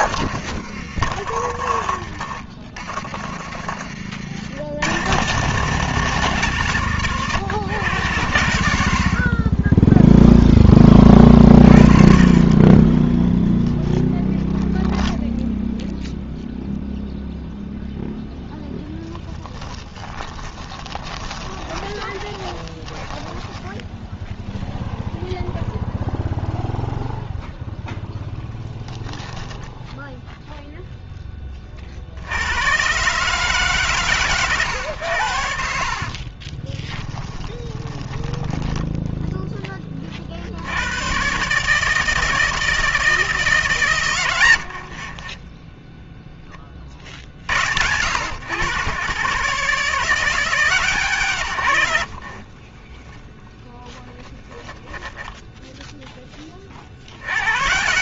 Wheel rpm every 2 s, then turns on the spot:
40, 60, 180, 120, 10, 40, 0, 0, 0, 20, 30, 20, 0, 0, 0, 20, 140, 70, 20, 20, 140, 150, 20, 60, 130, 130, 0, 10, 90.
0-4 8-10 18-24 34-38 44-46 54-56